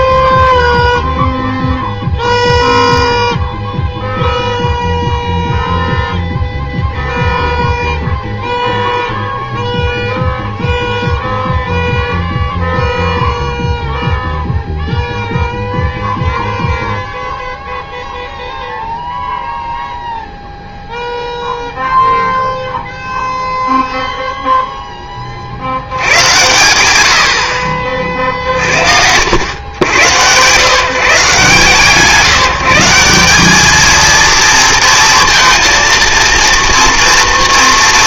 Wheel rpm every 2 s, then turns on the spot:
0, 0, 0, 0, 0, 0, 0, 0, 0, 0, 0, 0, 0, 100, 60, 140, 170, 230, 230.
none